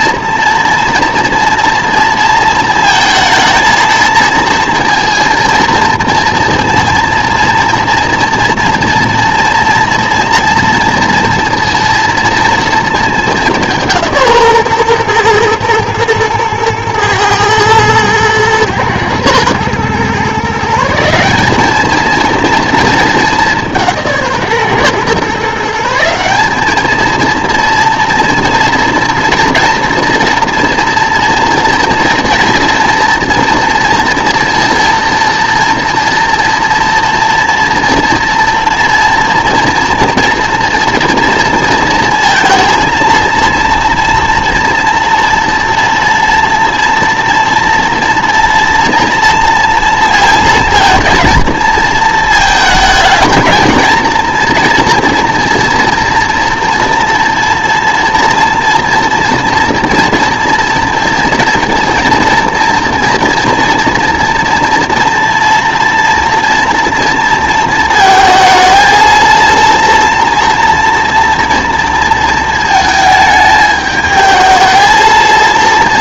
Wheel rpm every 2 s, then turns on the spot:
230, 230, 230, 230, 230, 230, 230, 140, 110, 120, 150, 230, 140, 200, 240, 230, 230, 230, 230, 230, 230, 230, 240, 230, 230, 230, 220, 230, 230, 230, 230, 230, 230, 240, 230, 230, 220, 220.
none